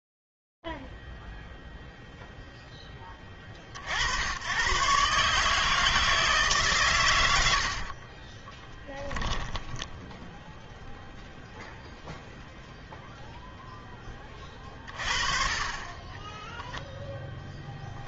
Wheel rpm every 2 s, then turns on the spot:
0, 0, 80, 150, 30, 0, 0, 50, 0.
8-10